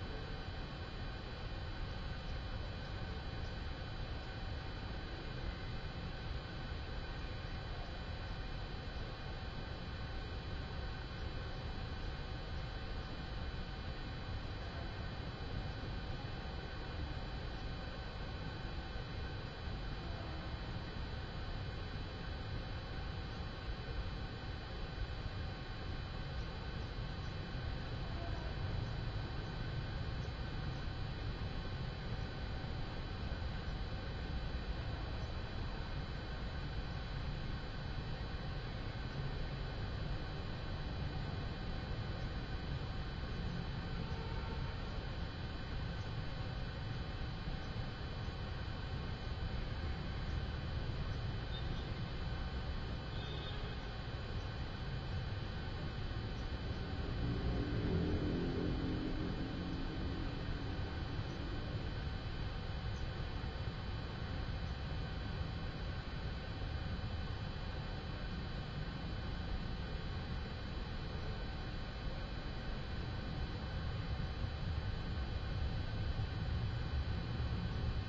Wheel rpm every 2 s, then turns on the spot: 0, 0, 0, 0, 0, 0, 0, 0, 0, 0, 0, 0, 0, 0, 0, 0, 0, 0, 0, 0, 0, 0, 0, 0, 0, 0, 0, 0, 0, 0, 0, 0, 0, 0, 0, 0, 0, 0, 0.
none